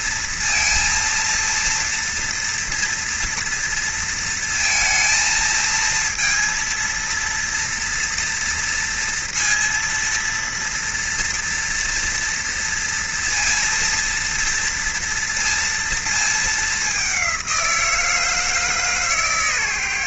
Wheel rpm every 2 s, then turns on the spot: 230, 240, 230, 230, 230, 230, 230, 230, 210, 160.
none